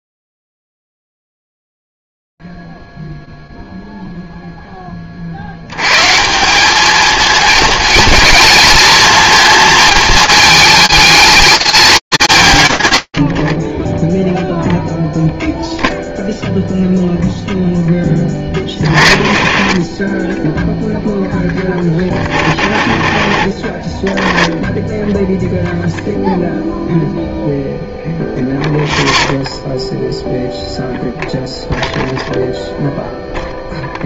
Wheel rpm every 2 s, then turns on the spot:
0, 0, 0, 110, 230, 220, 160, 10, 0, 10, 20, 20, 10, 0, 0, 0, 0.
none